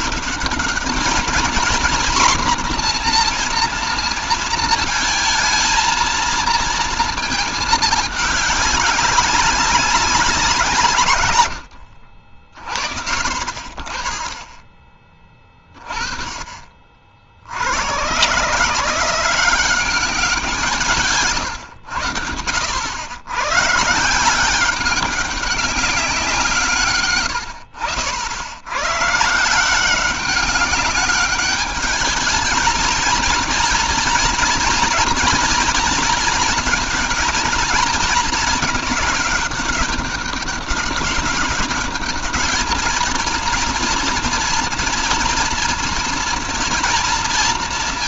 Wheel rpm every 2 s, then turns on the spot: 210, 250, 230, 230, 190, 160, 50, 20, 40, 160, 170, 90, 190, 140, 110, 200, 230, 230, 220, 220, 200, 210, 230, 230.
none